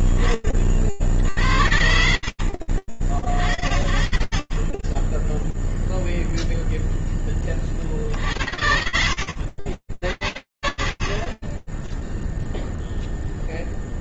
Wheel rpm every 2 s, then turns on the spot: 10, 80, 50, 0, 30, 60, 30.
none